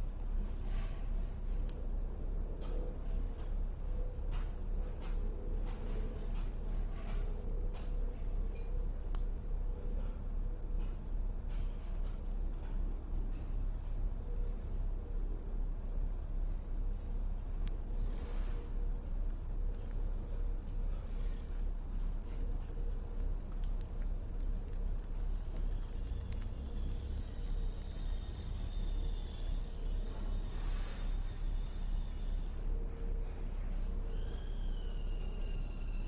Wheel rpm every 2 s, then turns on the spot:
0, 0, 0, 0, 0, 0, 0, 0, 0, 0, 0, 0, 0, 0, 0, 0, 0, 0.
none